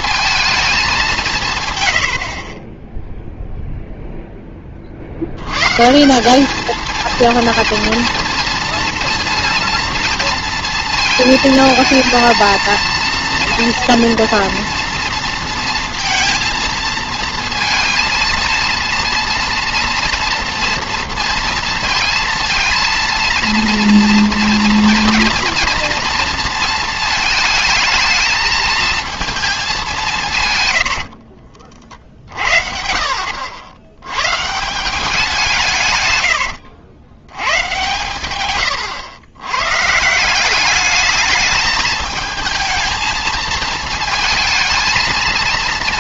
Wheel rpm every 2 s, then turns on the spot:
210, 20, 20, 220, 230, 230, 230, 230, 230, 230, 230, 230, 230, 230, 220, 100, 70, 170, 90, 120, 200, 220, 220.
36-38